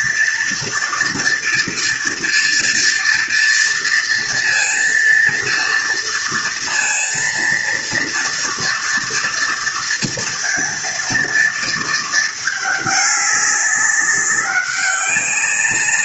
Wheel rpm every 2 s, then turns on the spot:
230, 230, 230, 230, 230, 230, 210, 200.
none